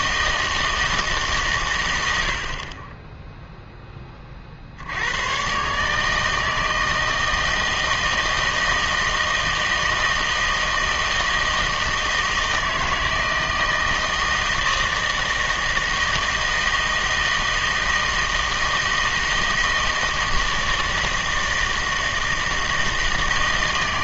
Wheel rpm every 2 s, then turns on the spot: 160, 40, 60, 160, 160, 160, 160, 160, 160, 160, 160, 160.
none